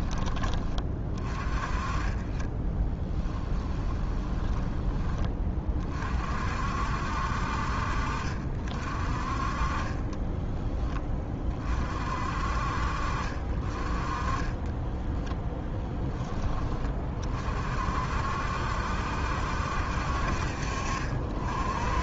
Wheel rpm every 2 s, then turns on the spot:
20, 10, 20, 60, 40, 20, 40, 10, 30, 70, 40.
2-4 14-16